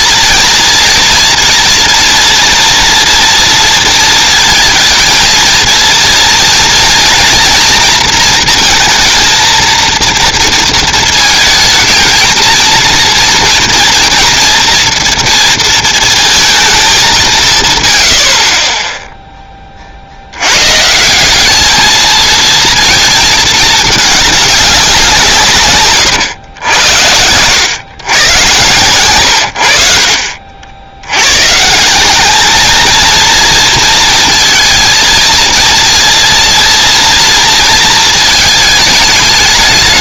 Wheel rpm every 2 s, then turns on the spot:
230, 240, 220, 230, 230, 230, 230, 230, 210, 30, 130, 230, 200, 110, 110, 60, 220, 230, 230, 220.
none